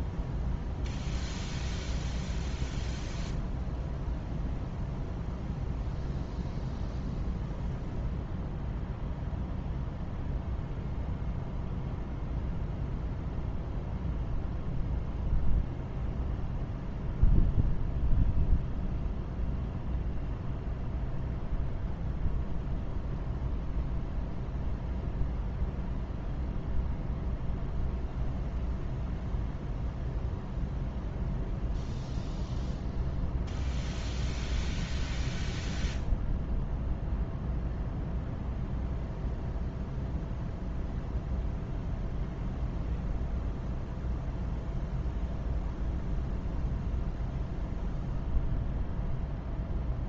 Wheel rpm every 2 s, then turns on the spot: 0, 0, 0, 0, 0, 0, 0, 0, 0, 0, 0, 0, 0, 0, 0, 0, 0, 0, 0, 0, 0, 0, 0, 0, 0.
none